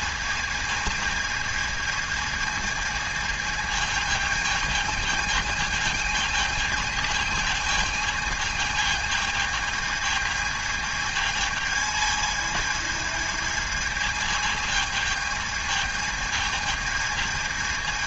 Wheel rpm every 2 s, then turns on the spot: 220, 220, 220, 220, 220, 220, 220, 220, 220.
none